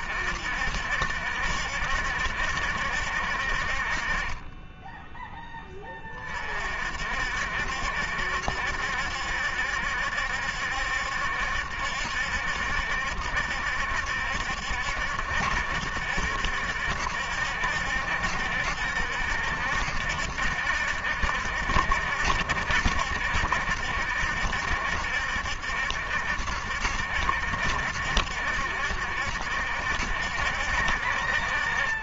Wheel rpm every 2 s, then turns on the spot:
70, 60, 10, 70, 70, 70, 70, 70, 70, 70, 60, 70, 70, 70, 70, 60.
none